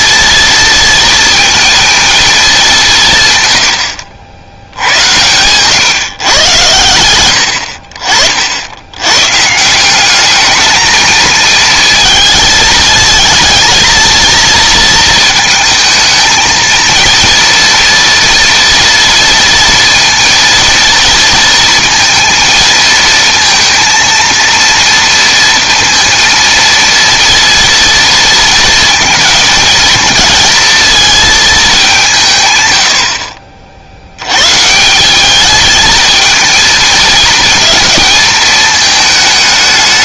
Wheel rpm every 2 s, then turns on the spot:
230, 170, 90, 100, 90, 220, 220, 230, 230, 230, 230, 230, 230, 230, 230, 220, 90, 160, 230, 220.
none